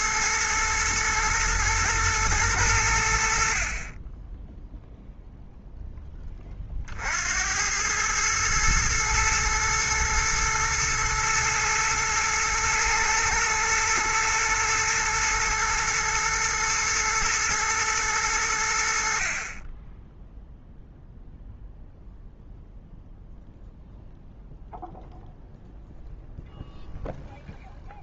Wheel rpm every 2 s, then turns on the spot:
110, 100, 0, 40, 110, 110, 110, 120, 120, 80, 0, 0, 0, 0.
none